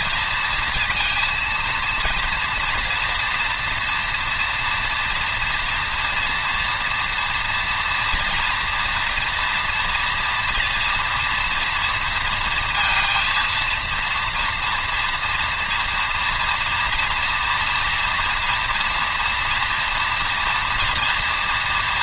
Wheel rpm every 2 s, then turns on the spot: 230, 230, 240, 230, 230, 230, 230, 230, 230, 240, 230.
none